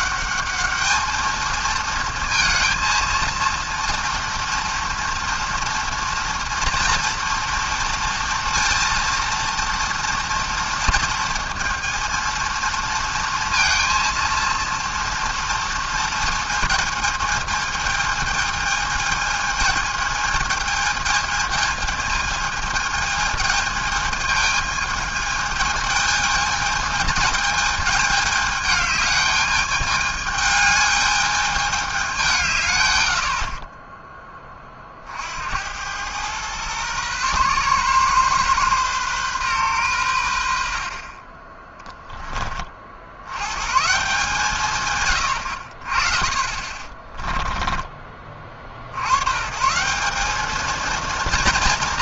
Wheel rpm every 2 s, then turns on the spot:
210, 230, 230, 240, 230, 230, 230, 230, 220, 220, 220, 220, 220, 220, 220, 210, 130, 20, 120, 130, 80, 30, 140, 40, 40, 220.
46-48